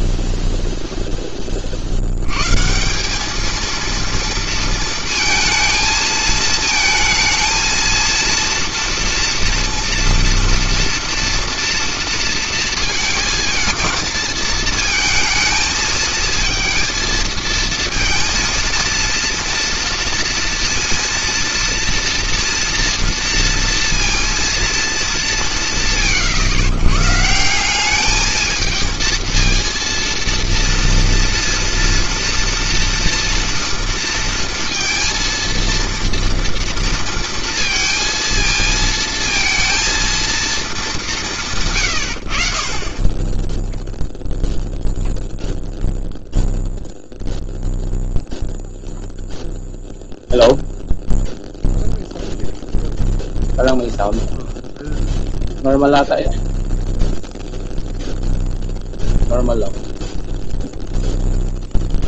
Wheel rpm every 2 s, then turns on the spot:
110, 230, 220, 230, 230, 230, 220, 220, 230, 230, 230, 230, 120, 220, 230, 230, 230, 230, 230, 230, 70, 0, 0, 0, 0, 0, 0, 0, 0, 0, 0.
none